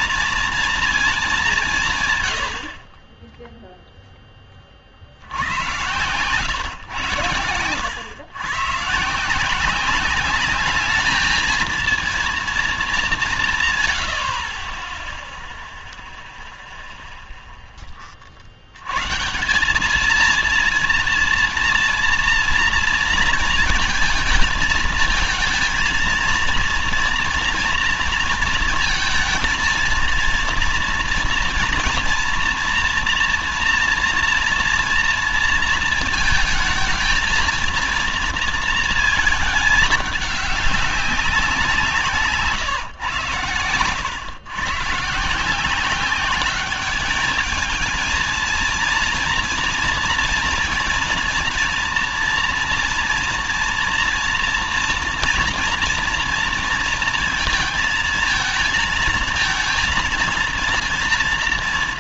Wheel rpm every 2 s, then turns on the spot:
230, 100, 20, 120, 130, 200, 230, 40, 0, 60, 230, 230, 220, 230, 230, 230, 240, 240, 220, 230, 200, 150, 110, 210, 230, 240, 230, 230, 230, 220, 230.
none